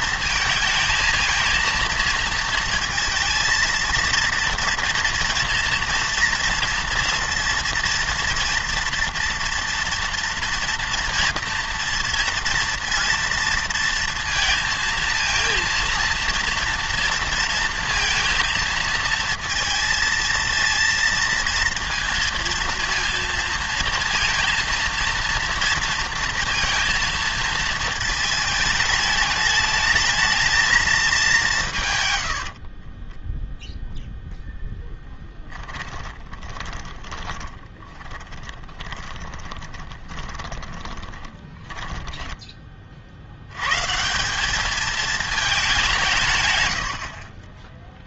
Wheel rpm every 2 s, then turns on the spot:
230, 230, 230, 230, 230, 230, 230, 230, 230, 230, 230, 230, 230, 230, 210, 220, 50, 10, 20, 20, 20, 30, 210, 100.
32-42